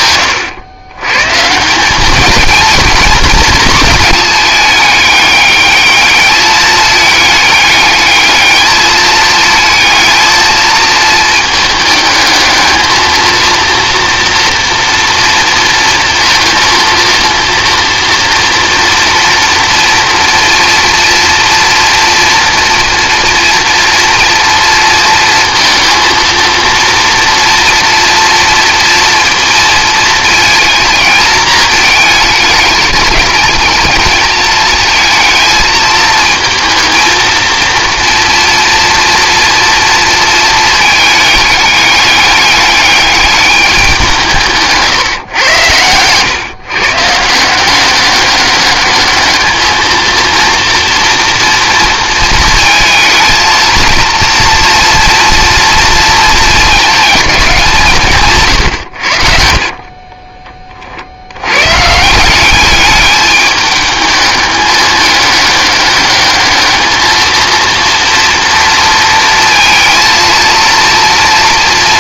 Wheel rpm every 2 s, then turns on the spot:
110, 230, 210, 210, 220, 220, 220, 230, 230, 240, 240, 230, 230, 230, 240, 220, 210, 220, 230, 230, 220, 210, 150, 130, 200, 230, 220, 230, 220, 110, 40, 210, 210, 220, 230, 230.
58-60